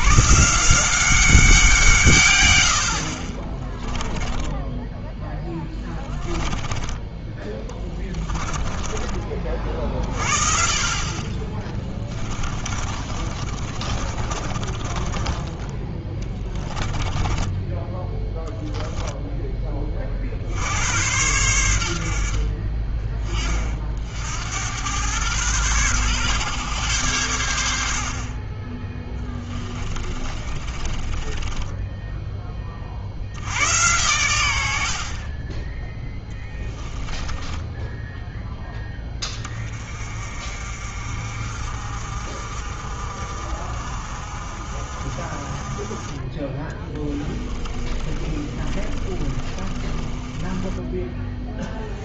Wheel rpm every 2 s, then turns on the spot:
170, 80, 10, 10, 30, 40, 40, 30, 20, 0, 80, 30, 90, 120, 20, 30, 30, 80, 10, 10, 50, 50, 50, 20, 30, 10.
4-10 12-18 30-32 36-38 48-52